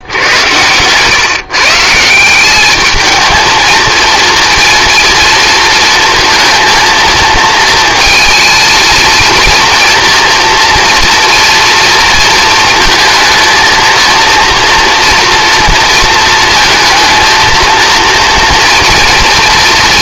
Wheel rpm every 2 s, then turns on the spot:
120, 210, 230, 230, 230, 230, 230, 230, 220, 230.
none